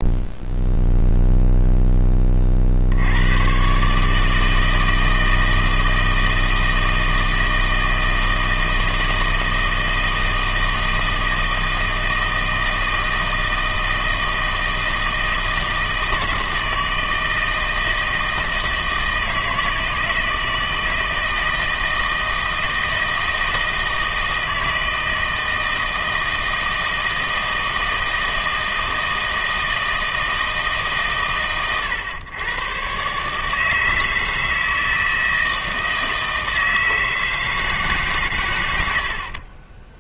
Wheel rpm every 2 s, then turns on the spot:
0, 50, 160, 160, 160, 160, 160, 160, 160, 160, 160, 160, 160, 160, 160, 160, 120, 160, 160, 100.
none